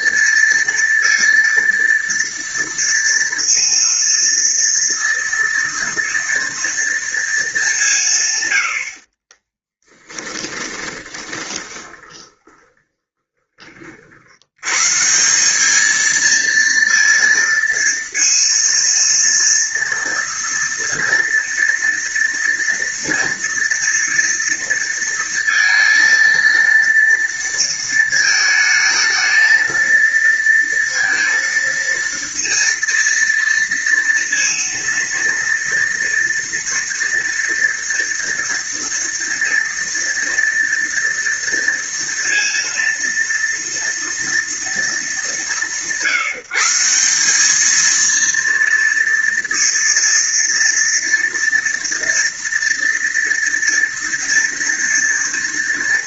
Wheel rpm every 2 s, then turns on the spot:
230, 230, 230, 230, 90, 30, 20, 110, 230, 230, 230, 230, 230, 230, 220, 230, 230, 230, 230, 230, 230, 230, 220, 170, 230, 230, 230, 230.
10-14